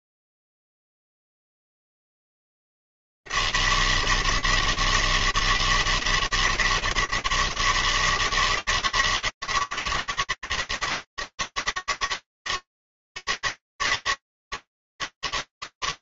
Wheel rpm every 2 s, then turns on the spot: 100, 160, 160, 150, 150, 140, 140, 100.
none